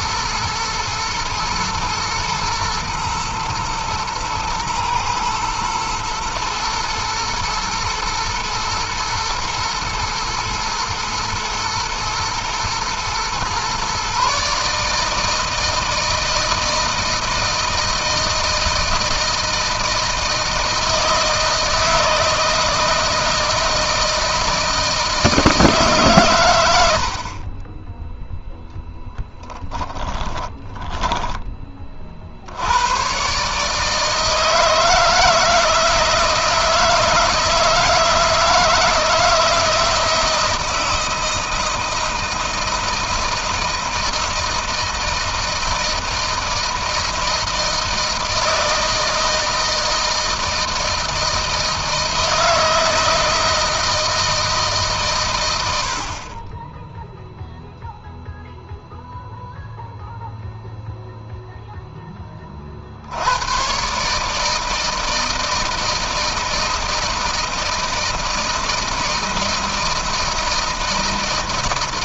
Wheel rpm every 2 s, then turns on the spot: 110, 120, 110, 110, 110, 110, 120, 160, 160, 160, 160, 160, 160, 80, 10, 10, 120, 160, 170, 160, 160, 160, 160, 160, 160, 160, 160, 140, 0, 0, 0, 80, 160, 160, 160, 160.
none